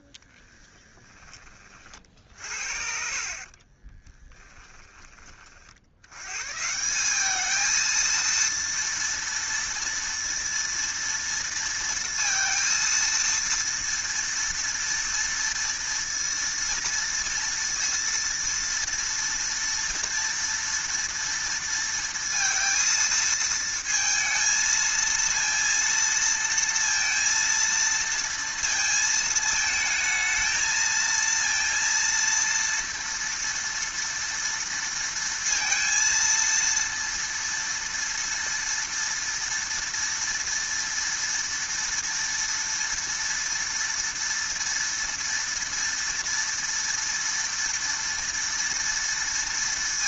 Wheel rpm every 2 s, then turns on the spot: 10, 50, 10, 160, 230, 230, 230, 230, 230, 230, 230, 230, 220, 230, 230, 220, 230, 230, 230, 230, 230, 230, 230, 230, 230.
0-2 4-6